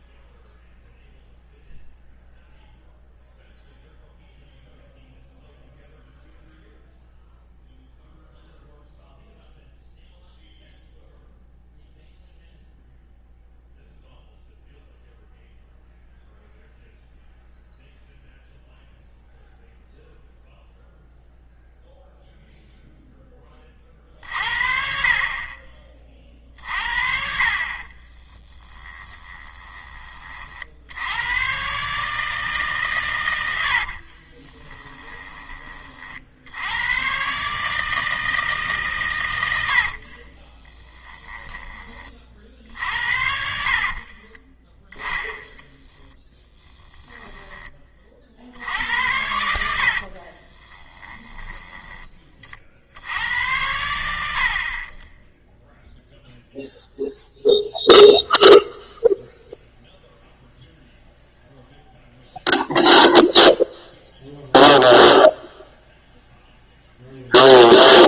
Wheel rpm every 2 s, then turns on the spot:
0, 0, 0, 0, 0, 0, 0, 0, 0, 0, 0, 0, 50, 40, 20, 60, 140, 20, 90, 150, 20, 60, 10, 10, 70, 20, 50, 50, 0, 0, 0, 0, 0, 0.
28-30 34-36 40-42 44-48 50-52